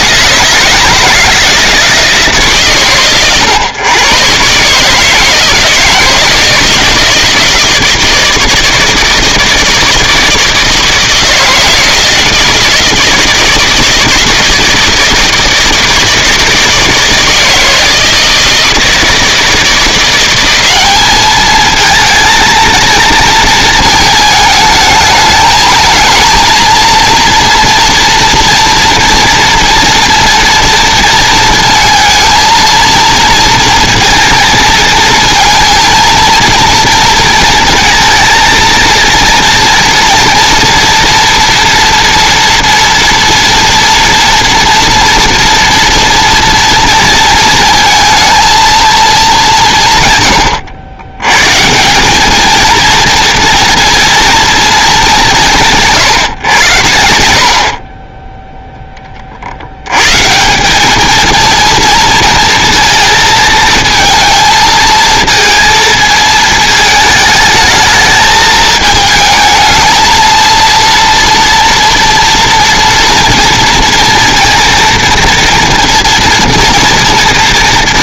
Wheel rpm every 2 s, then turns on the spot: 160, 120, 140, 160, 160, 160, 160, 160, 160, 160, 200, 230, 220, 230, 230, 230, 230, 220, 230, 230, 230, 230, 230, 230, 230, 100, 220, 230, 100, 10, 210, 220, 220, 220, 220, 240, 230, 230, 230.
none